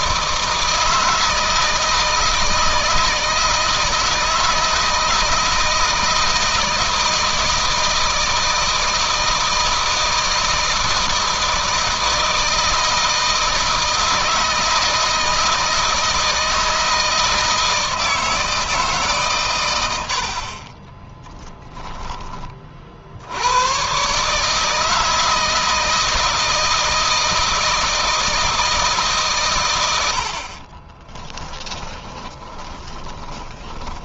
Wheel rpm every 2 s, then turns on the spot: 160, 160, 160, 160, 160, 160, 160, 160, 160, 150, 40, 60, 160, 160, 150, 40, 20.
20-22 30-34